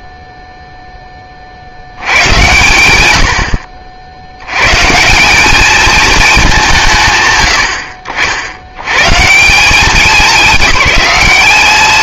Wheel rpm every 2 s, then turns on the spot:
0, 100, 70, 210, 70, 200.
none